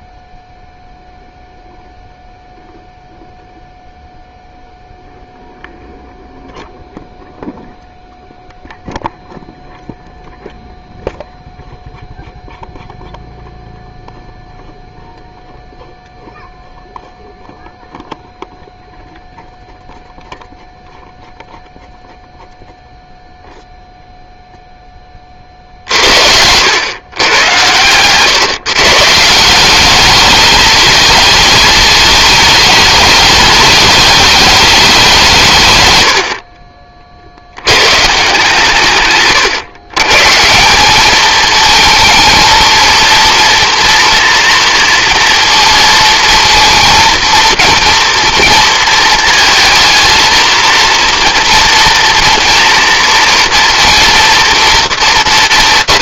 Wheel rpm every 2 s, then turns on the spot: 0, 0, 0, 0, 0, 0, 0, 0, 0, 0, 0, 0, 10, 110, 140, 220, 210, 200, 40, 140, 190, 230, 230, 230, 230, 230, 230, 220.
none